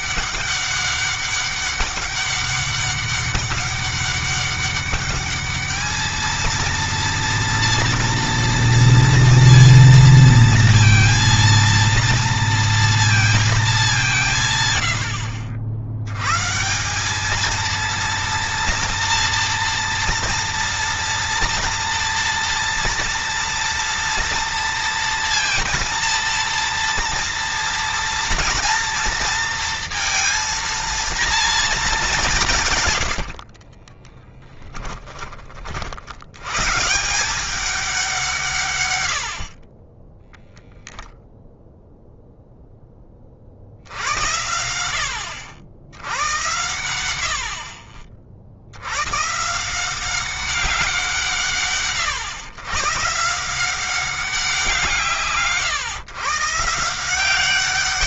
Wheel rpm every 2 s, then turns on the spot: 200, 200, 200, 230, 230, 230, 230, 110, 170, 230, 230, 230, 230, 230, 230, 230, 130, 10, 150, 120, 0, 10, 70, 90, 80, 180, 140, 170, 160.
32-34